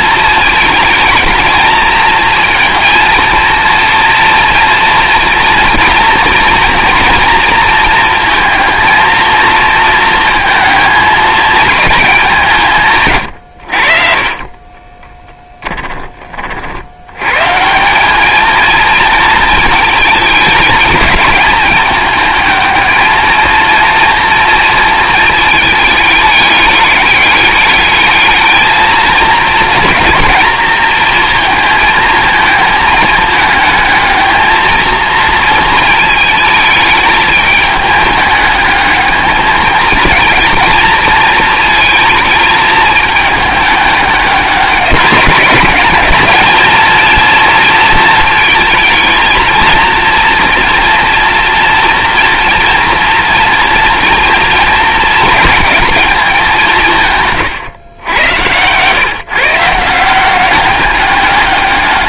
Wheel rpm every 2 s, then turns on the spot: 230, 230, 230, 230, 220, 190, 50, 30, 200, 220, 210, 230, 210, 210, 220, 220, 220, 220, 210, 220, 220, 210, 210, 230, 230, 230, 230, 210, 100, 170, 210.
none